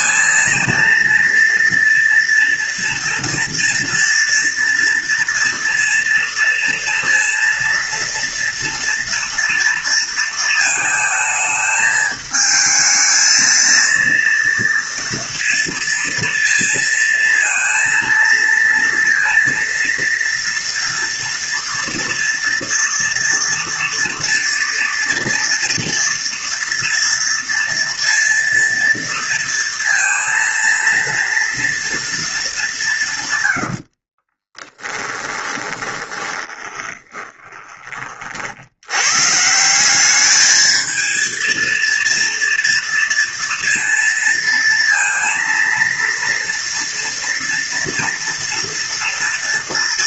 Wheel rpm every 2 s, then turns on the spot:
230, 230, 230, 230, 230, 220, 220, 230, 230, 230, 230, 230, 230, 230, 230, 230, 180, 20, 20, 90, 220, 230, 230, 230, 230.
34-38